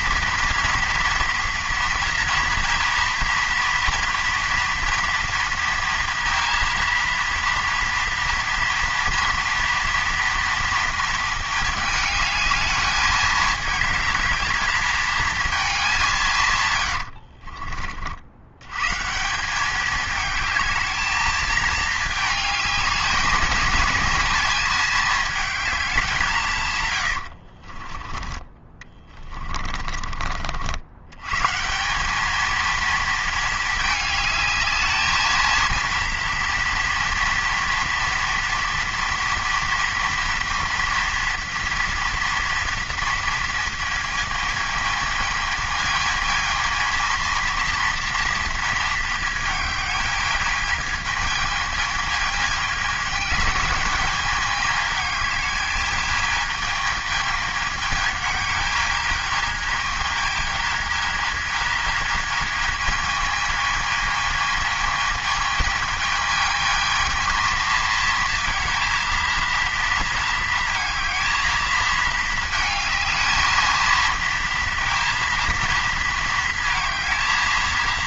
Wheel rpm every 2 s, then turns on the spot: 230, 230, 240, 230, 230, 230, 210, 220, 120, 110, 220, 210, 210, 140, 20, 70, 220, 220, 230, 230, 230, 230, 220, 220, 230, 210, 210, 210, 220, 210, 220, 220, 220, 220, 230, 230, 220, 230, 230.
16-18 28-30